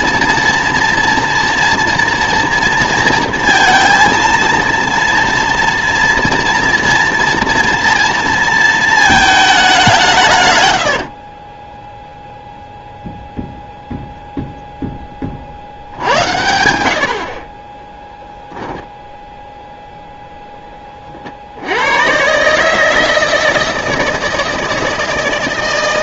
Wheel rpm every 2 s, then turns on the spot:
230, 230, 230, 230, 230, 110, 0, 0, 80, 0, 10, 150, 160.
none